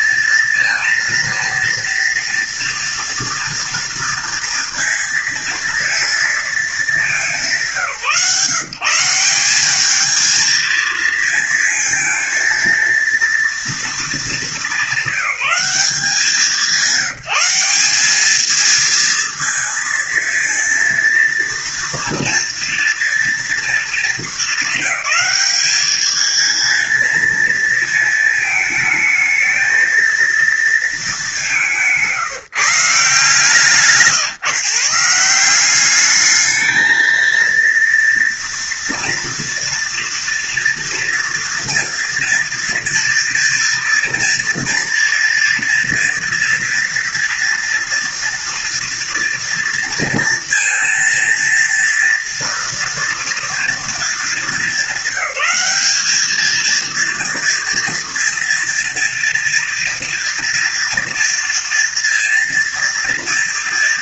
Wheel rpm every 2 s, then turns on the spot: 230, 230, 230, 210, 160, 220, 230, 210, 170, 230, 230, 230, 220, 220, 220, 220, 160, 160, 220, 230, 230, 230, 230, 240, 230, 230, 240, 200, 230, 230, 230, 230.
none